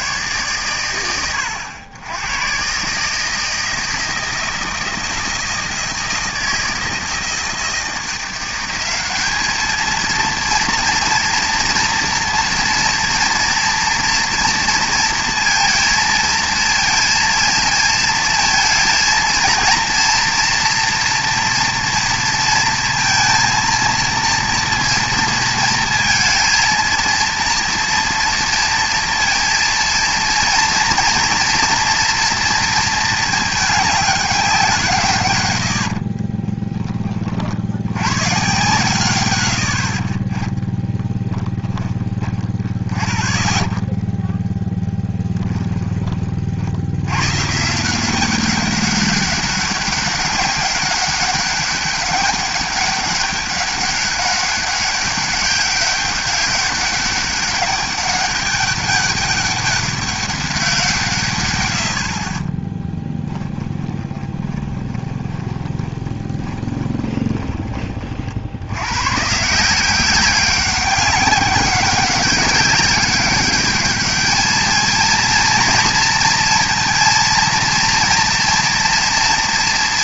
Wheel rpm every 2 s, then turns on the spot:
110, 140, 160, 160, 190, 230, 230, 230, 230, 230, 230, 230, 230, 230, 230, 240, 230, 170, 20, 110, 30, 30, 10, 60, 190, 200, 200, 200, 200, 200, 170, 10, 20, 20, 90, 190, 200, 220, 230, 230.
40-44 62-68